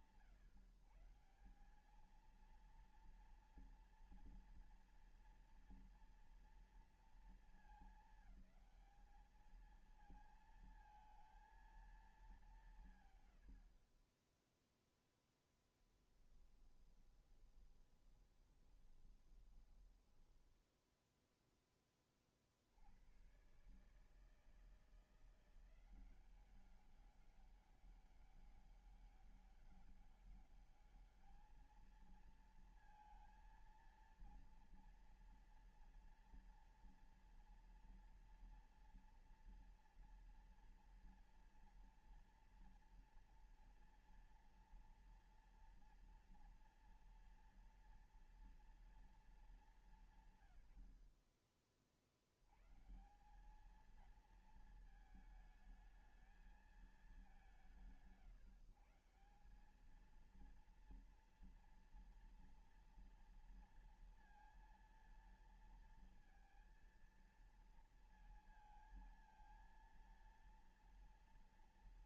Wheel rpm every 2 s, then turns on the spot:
150, 230, 230, 230, 220, 220, 170, 10, 10, 20, 10, 90, 160, 190, 200, 210, 230, 230, 230, 230, 230, 230, 230, 240, 230, 100, 120, 220, 200, 150, 230, 230, 230, 230, 230, 230.
16-22